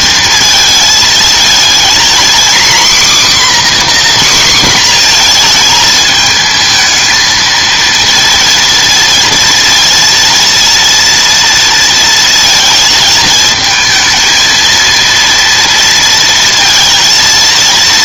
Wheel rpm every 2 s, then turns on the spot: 230, 260, 260, 220, 230, 230, 230, 230, 230.
none